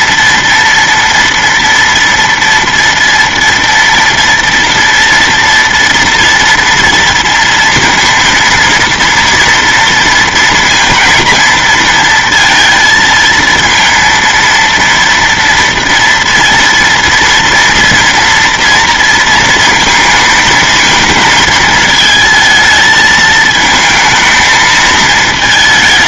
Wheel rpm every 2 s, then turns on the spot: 230, 230, 230, 230, 230, 230, 230, 230, 230, 230, 220, 220, 220.
none